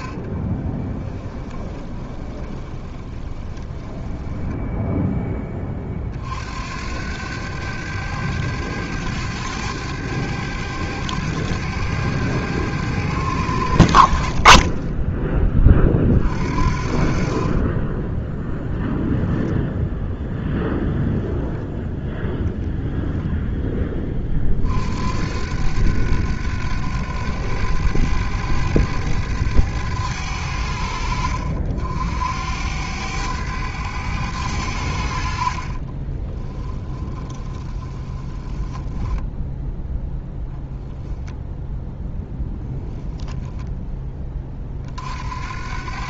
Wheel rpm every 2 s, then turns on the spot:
20, 20, 0, 80, 100, 100, 90, 20, 50, 10, 10, 0, 70, 100, 100, 70, 90, 70, 20, 10, 10, 10, 50.
0-4 14-16 36-40